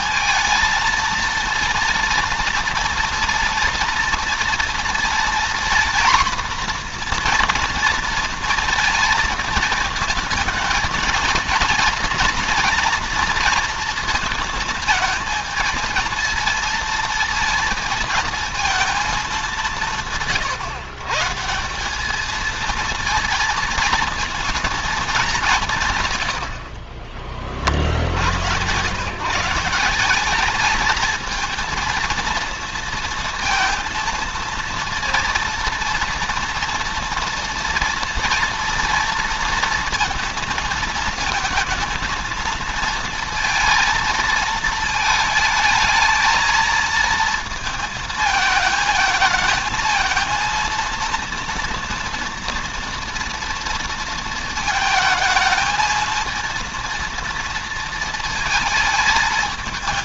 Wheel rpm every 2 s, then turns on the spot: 230, 230, 230, 240, 230, 220, 240, 220, 220, 210, 150, 230, 210, 50, 130, 220, 230, 230, 230, 230, 220, 230, 220, 230, 220, 230, 230, 220, 230, 220.
26-28